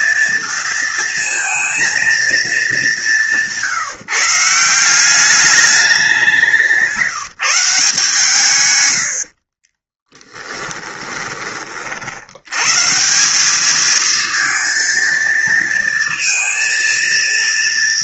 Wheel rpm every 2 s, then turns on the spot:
230, 190, 180, 180, 110, 20, 150, 230, 230.
10-12